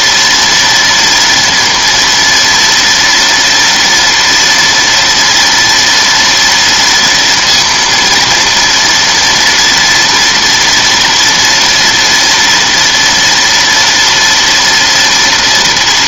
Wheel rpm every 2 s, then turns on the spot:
230, 230, 230, 230, 230, 240, 240, 230.
none